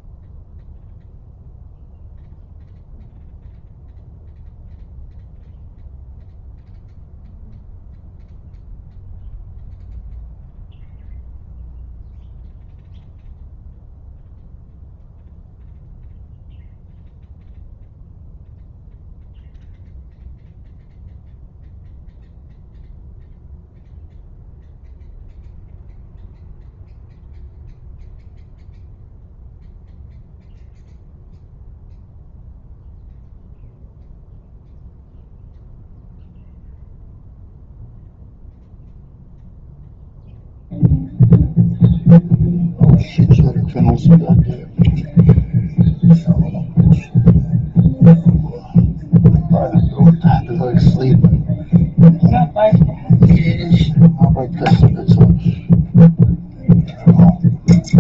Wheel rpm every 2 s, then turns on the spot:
0, 0, 0, 0, 0, 0, 0, 0, 0, 0, 0, 0, 0, 0, 0, 0, 0, 0, 0, 0, 0, 0, 0, 0, 0, 0, 0, 0, 0.
none